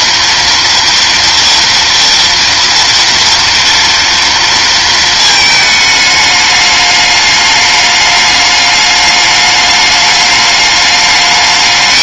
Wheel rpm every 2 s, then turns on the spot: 230, 230, 230, 210, 210, 210.
none